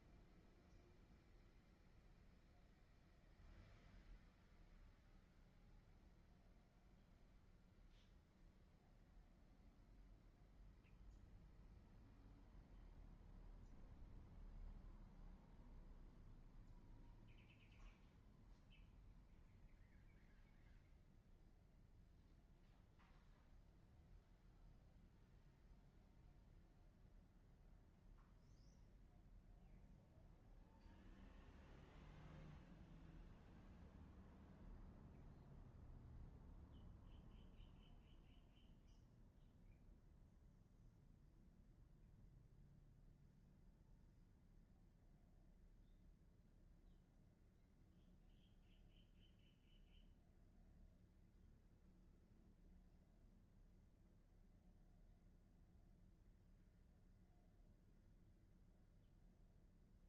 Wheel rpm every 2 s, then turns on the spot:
0, 0, 0, 0, 0, 0, 0, 0, 0, 0, 0, 0, 0, 0, 0, 0, 0, 0, 0, 0, 0, 0, 0, 0, 0, 0, 0, 0, 0, 0.
none